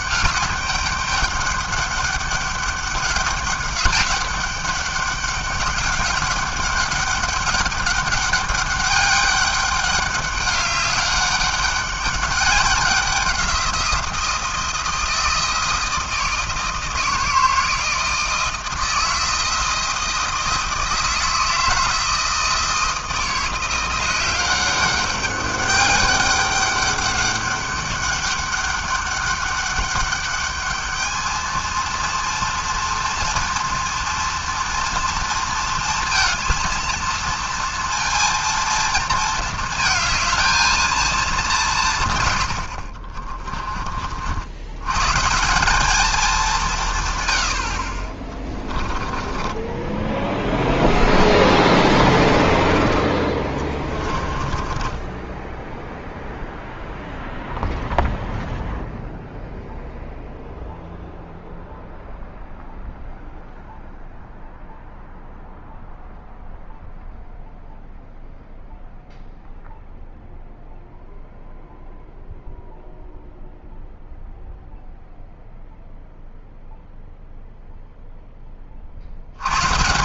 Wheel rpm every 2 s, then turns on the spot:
200, 200, 200, 200, 200, 200, 200, 160, 160, 160, 160, 160, 190, 200, 200, 210, 230, 230, 230, 230, 220, 60, 110, 160, 20, 0, 30, 10, 0, 0, 0, 0, 0, 0, 0, 0, 0, 0, 0, 30.
48-50 54-56